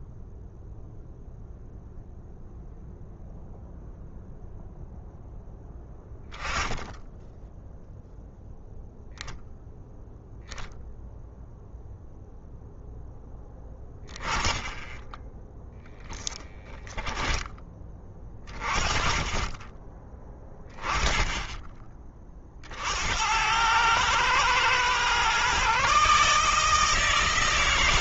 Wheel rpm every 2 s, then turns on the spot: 0, 0, 0, 10, 0, 0, 0, 10, 10, 30, 20, 70, 120, 160.
16-18